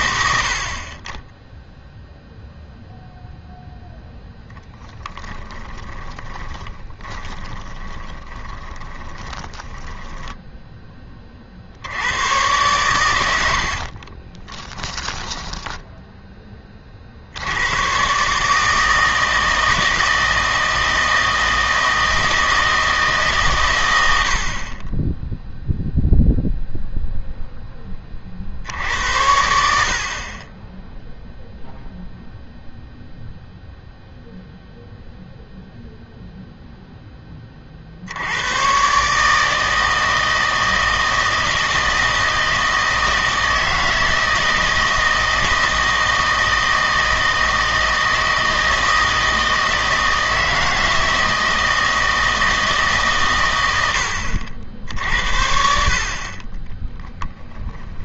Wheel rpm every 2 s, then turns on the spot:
60, 0, 20, 20, 20, 10, 120, 20, 30, 150, 160, 160, 40, 0, 60, 10, 0, 0, 0, 120, 160, 160, 160, 160, 160, 160, 150, 70, 30.
4-10 14-16 56-58